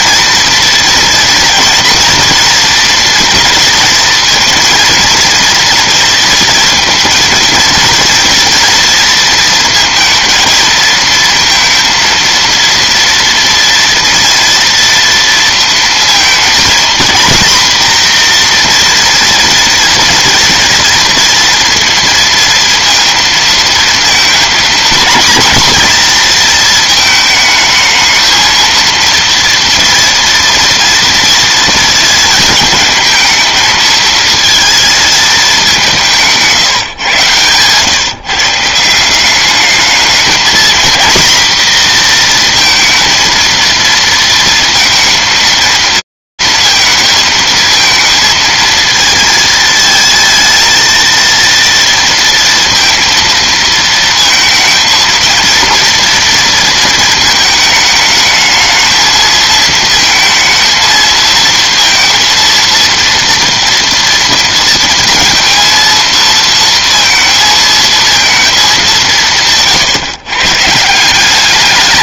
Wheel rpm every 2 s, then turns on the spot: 240, 230, 230, 230, 230, 230, 230, 230, 230, 240, 230, 230, 240, 230, 230, 230, 210, 230, 160, 160, 230, 230, 230, 220, 230, 230, 230, 220, 220, 220, 220, 230, 230, 230, 180, 170.
none